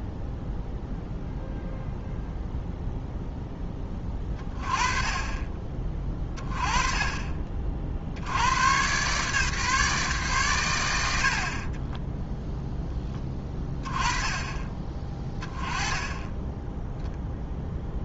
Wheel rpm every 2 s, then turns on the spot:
0, 0, 20, 20, 120, 100, 10, 20, 10.
none